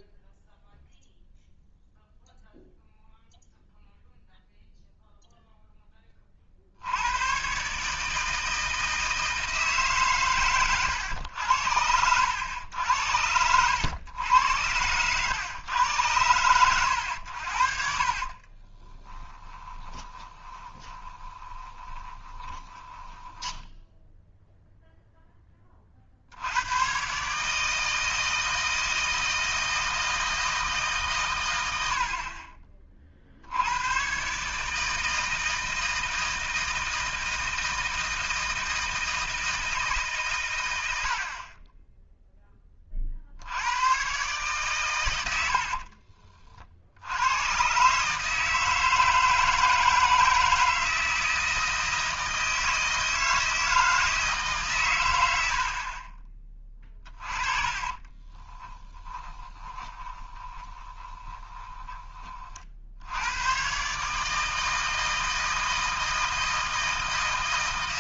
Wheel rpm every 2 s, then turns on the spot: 0, 0, 0, 60, 160, 110, 90, 100, 100, 30, 20, 20, 0, 100, 160, 160, 30, 150, 160, 160, 100, 20, 130, 50, 160, 160, 160, 140, 20, 20, 20, 60, 160, 160.
18-24 58-62